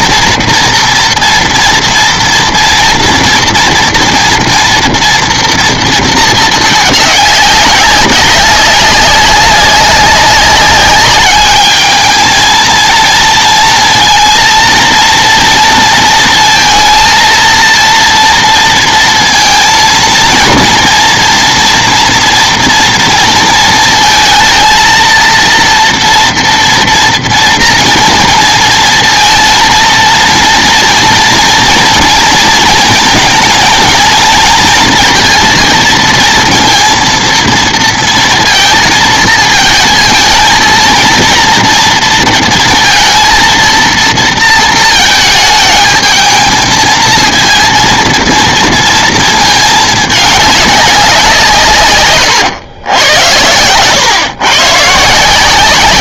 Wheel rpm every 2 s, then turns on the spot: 230, 230, 230, 220, 190, 200, 220, 230, 230, 230, 230, 230, 230, 230, 230, 230, 220, 220, 230, 230, 220, 230, 230, 220, 230, 200, 110, 130.
none